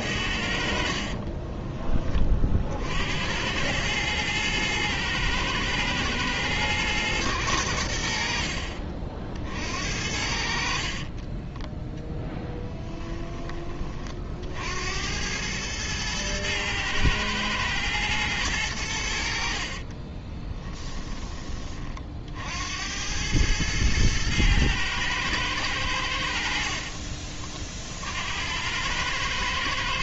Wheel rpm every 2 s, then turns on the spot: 50, 60, 110, 110, 50, 40, 10, 80, 110, 90, 10, 80, 110, 40, 100.
0-2 10-14 26-28